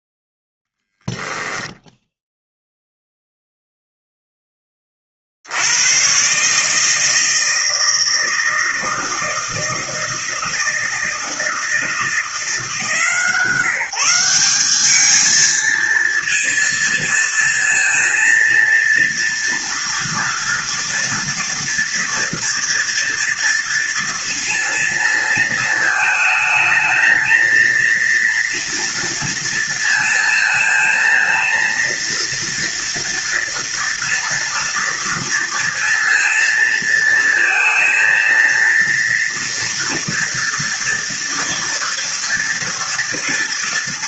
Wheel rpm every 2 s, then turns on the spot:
0, 0, 20, 150, 160, 160, 160, 200, 230, 230, 230, 230, 230, 220, 230, 230, 230, 230, 230, 230, 230, 230.
none